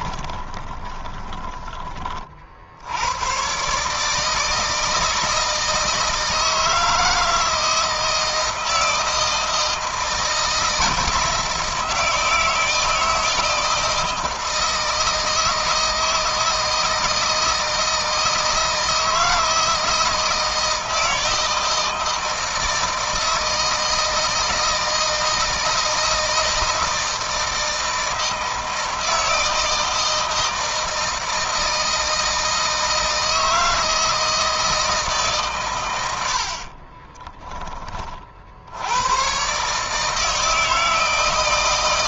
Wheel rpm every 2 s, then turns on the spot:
20, 70, 160, 160, 160, 160, 160, 160, 160, 160, 160, 160, 160, 160, 160, 160, 160, 160, 40, 70, 160.
0-2 36-38